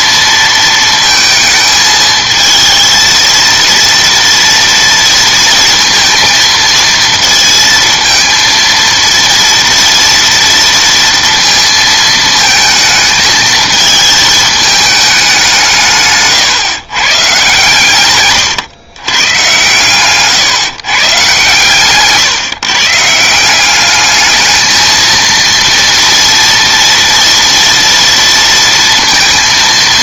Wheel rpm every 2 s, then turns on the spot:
230, 220, 230, 220, 230, 230, 220, 220, 140, 130, 140, 140, 220, 230, 230.
none